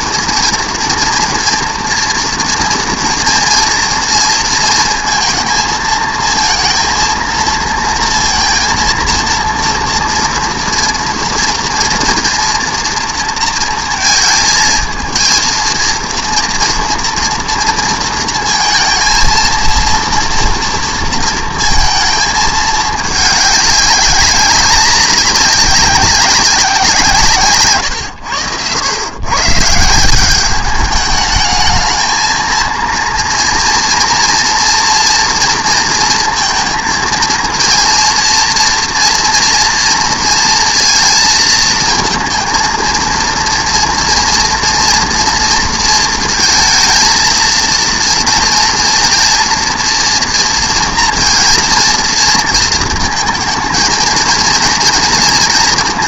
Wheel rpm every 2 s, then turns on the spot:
230, 230, 230, 230, 230, 230, 230, 230, 230, 230, 230, 220, 200, 190, 100, 200, 230, 230, 230, 230, 230, 230, 230, 230, 230, 230, 230, 230.
none